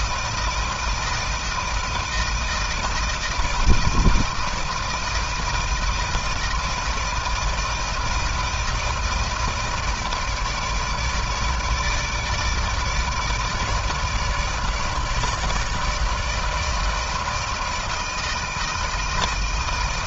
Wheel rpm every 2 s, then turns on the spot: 160, 160, 160, 160, 160, 160, 150, 150, 160, 160.
none